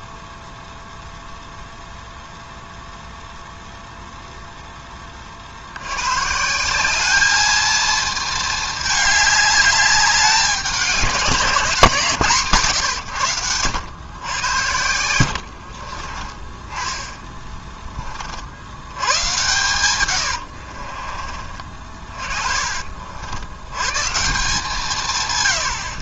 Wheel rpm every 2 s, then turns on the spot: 0, 0, 20, 200, 210, 200, 140, 80, 10, 110, 40, 60, 150.
14-18 20-22